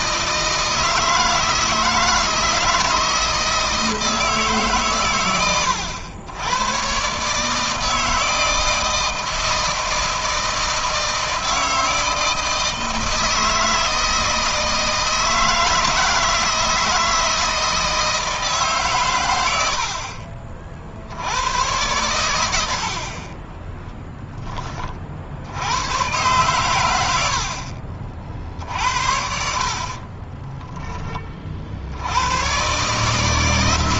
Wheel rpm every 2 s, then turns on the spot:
160, 160, 130, 130, 160, 160, 160, 160, 160, 130, 70, 50, 40, 100, 70, 20, 140.
none